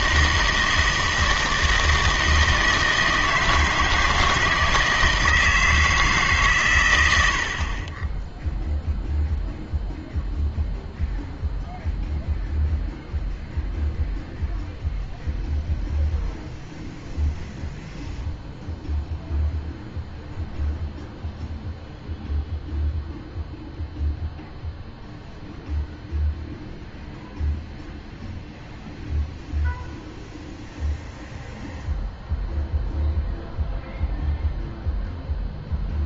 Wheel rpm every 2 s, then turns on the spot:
160, 160, 160, 130, 0, 0, 0, 0, 0, 0, 0, 0, 0, 0, 0, 0, 0, 0.
none